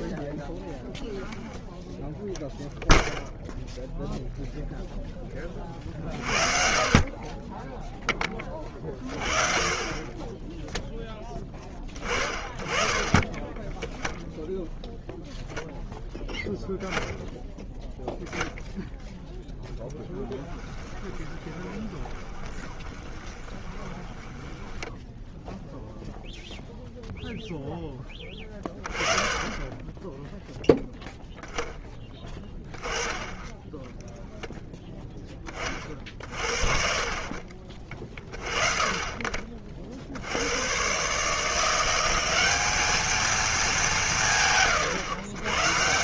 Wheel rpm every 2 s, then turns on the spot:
10, 0, 0, 60, 20, 20, 20, 0, 10, 0, 10, 20, 10, 0, 10, 10, 10, 0, 50, 30, 70, 190, 180.
20-26